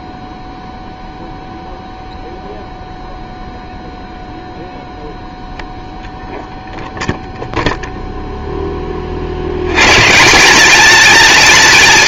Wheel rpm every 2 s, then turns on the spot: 0, 0, 0, 0, 20, 210.
none